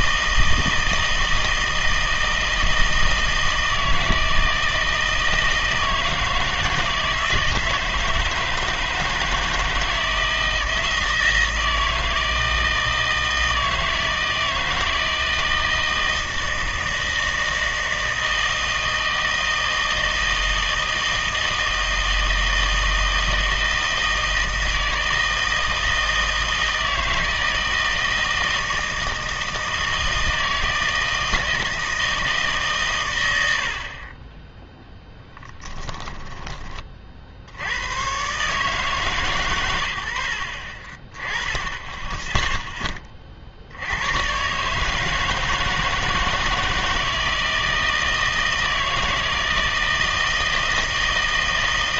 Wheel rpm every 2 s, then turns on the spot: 160, 160, 160, 160, 160, 160, 160, 160, 160, 160, 160, 160, 160, 160, 160, 160, 140, 10, 20, 150, 40, 10, 140, 160, 160, 160.
none